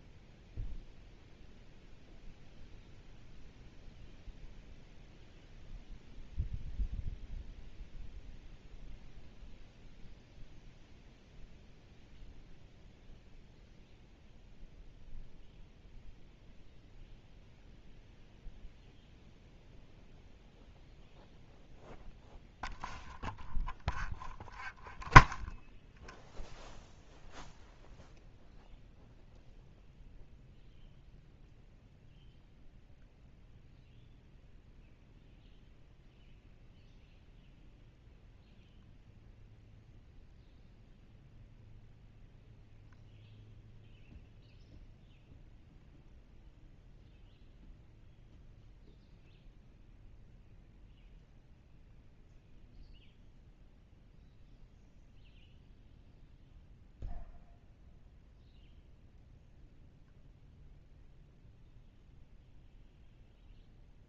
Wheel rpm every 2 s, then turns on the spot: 0, 0, 0, 0, 0, 0, 0, 0, 0, 0, 0, 0, 0, 0, 0, 0, 0, 0, 0, 0, 0, 0, 0, 0, 0, 0, 0, 0, 0, 0, 0, 0.
none